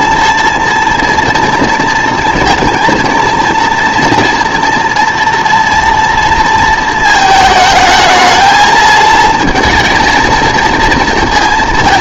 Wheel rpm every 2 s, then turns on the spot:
230, 230, 240, 230, 220, 230.
none